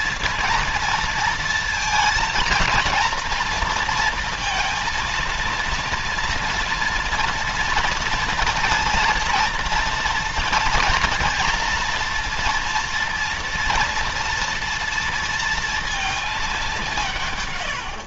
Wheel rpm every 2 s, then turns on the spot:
230, 230, 230, 230, 230, 230, 230, 240, 210.
none